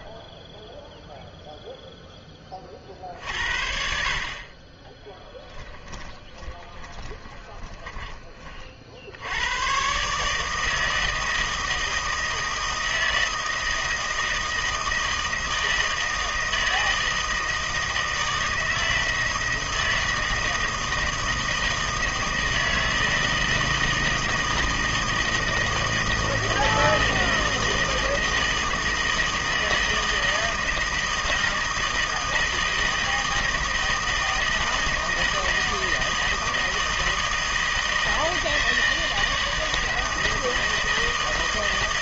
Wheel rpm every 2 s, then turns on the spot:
0, 30, 30, 20, 40, 160, 160, 160, 160, 160, 160, 160, 160, 160, 160, 160, 160, 160, 160, 160, 160.
6-8